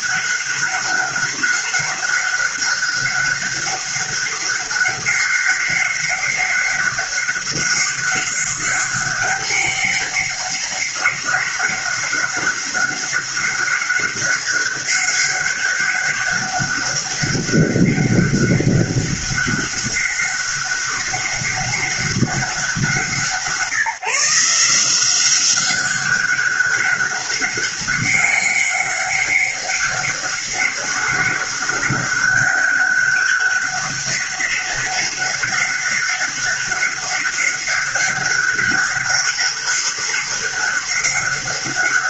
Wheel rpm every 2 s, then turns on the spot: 200, 200, 200, 200, 200, 200, 200, 200, 200, 200, 200, 170, 180, 200, 200, 200, 200, 190, 200, 200, 200.
none